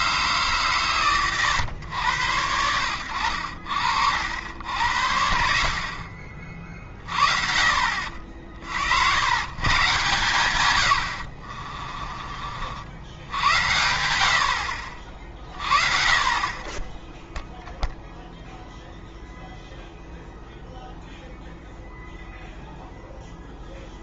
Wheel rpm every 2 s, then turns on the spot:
140, 80, 80, 40, 60, 120, 50, 60, 30, 0, 0, 0.
none